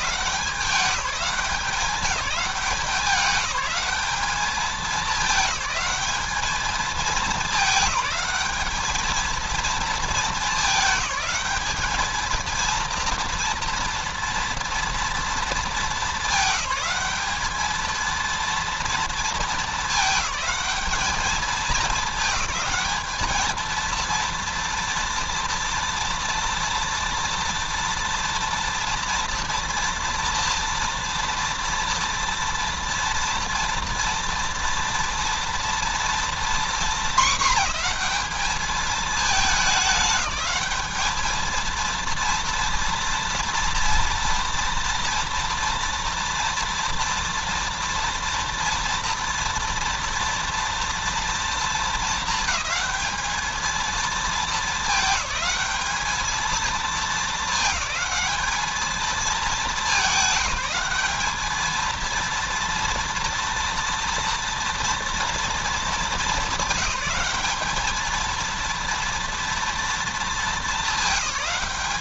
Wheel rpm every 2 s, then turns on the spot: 190, 190, 210, 210, 210, 200, 220, 230, 200, 230, 210, 210, 230, 230, 230, 230, 230, 230, 230, 220, 210, 230, 240, 230, 230, 230, 220, 220, 220, 220, 190, 230, 230, 200, 230, 220.
none